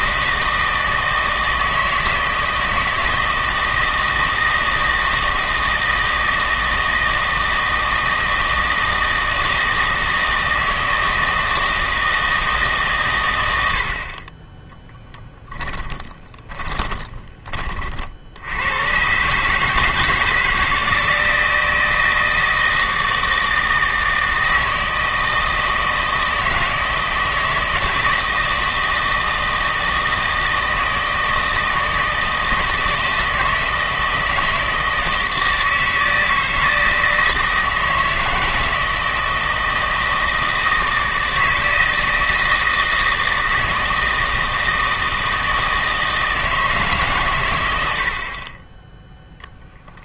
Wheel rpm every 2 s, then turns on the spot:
160, 160, 160, 160, 160, 160, 150, 10, 20, 100, 160, 160, 160, 160, 160, 160, 160, 160, 160, 160, 160, 160, 160, 150, 10.
16-18